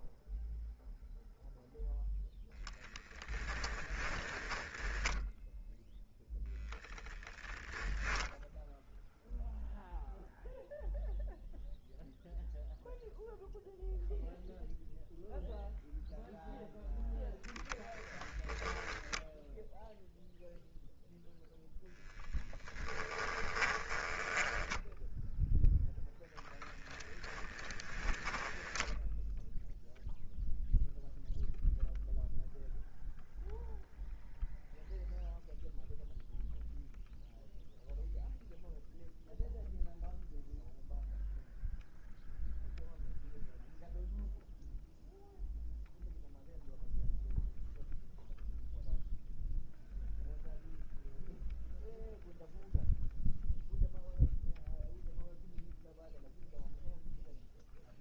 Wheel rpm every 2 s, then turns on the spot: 0, 10, 10, 0, 0, 0, 0, 0, 0, 0, 0, 10, 10, 10, 0, 0, 0, 0, 0, 0, 0, 0, 0, 0, 0, 0, 0, 0, 0.
4-6 22-26